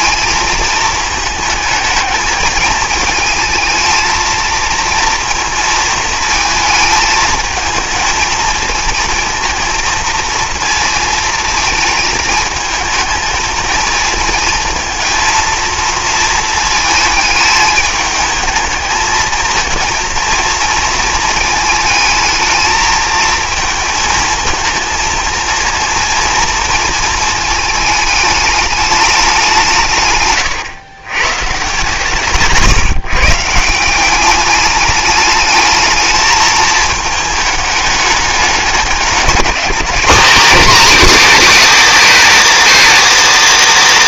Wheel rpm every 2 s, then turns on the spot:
220, 220, 230, 220, 220, 230, 220, 220, 230, 220, 220, 220, 220, 230, 210, 130, 140, 200, 220, 200, 230, 190.
none